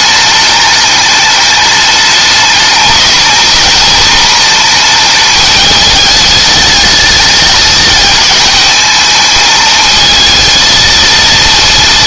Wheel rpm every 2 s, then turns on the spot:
210, 210, 220, 210, 210, 230.
none